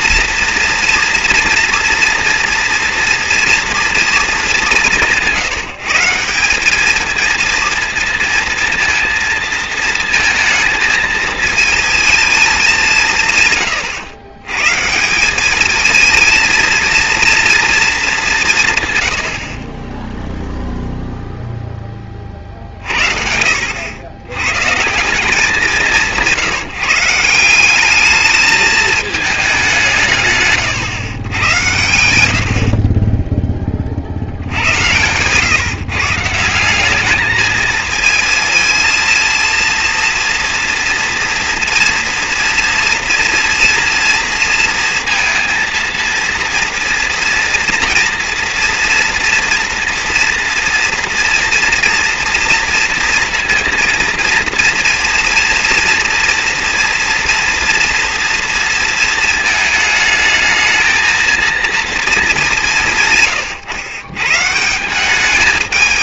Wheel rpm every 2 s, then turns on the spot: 230, 230, 200, 200, 230, 220, 200, 130, 230, 160, 0, 50, 130, 170, 220, 140, 60, 70, 180, 230, 230, 230, 230, 230, 240, 230, 230, 230, 240, 230, 220, 180, 150.
none